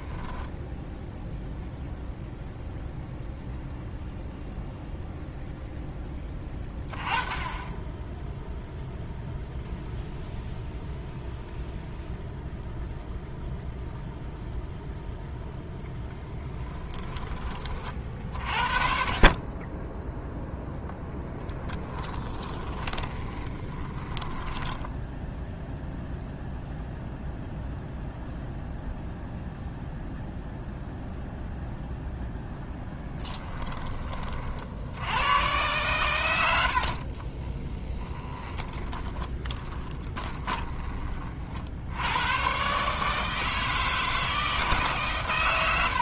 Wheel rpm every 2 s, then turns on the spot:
0, 0, 0, 20, 0, 0, 0, 0, 10, 40, 10, 20, 10, 0, 0, 0, 10, 70, 60, 20, 20, 140, 150.
22-26 32-34 36-40